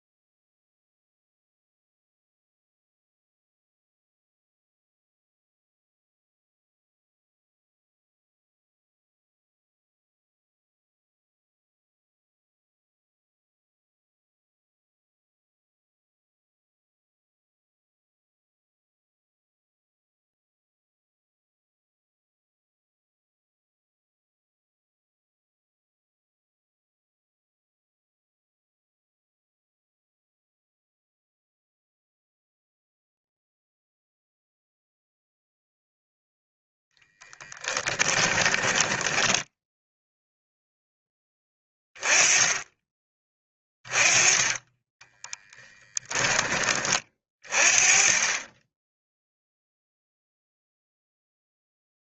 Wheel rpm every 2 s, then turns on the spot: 0, 0, 0, 0, 0, 0, 0, 0, 0, 0, 0, 0, 0, 0, 0, 0, 0, 0, 0, 10, 0, 20, 10, 20, 10, 0.
38-40